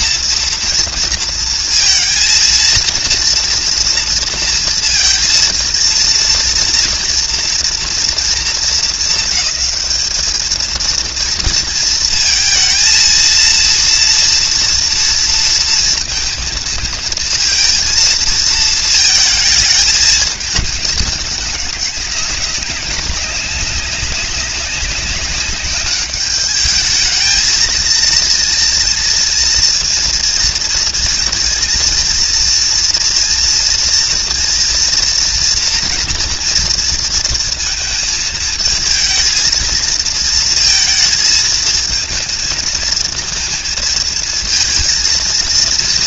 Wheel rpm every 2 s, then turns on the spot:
230, 230, 230, 230, 220, 220, 230, 230, 230, 220, 220, 200, 200, 210, 230, 230, 230, 230, 230, 220, 230, 230, 230.
none